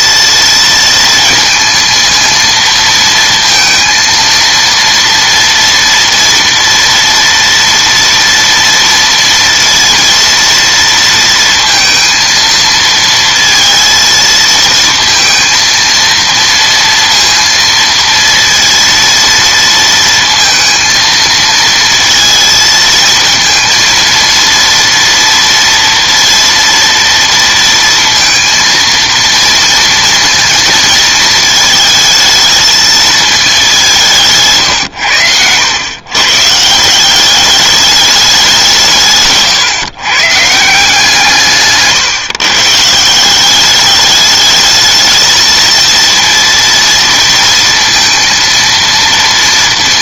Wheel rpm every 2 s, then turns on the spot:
230, 230, 230, 230, 230, 230, 230, 220, 230, 230, 230, 230, 230, 230, 230, 230, 220, 130, 150, 170, 160, 140, 210, 230, 230.
none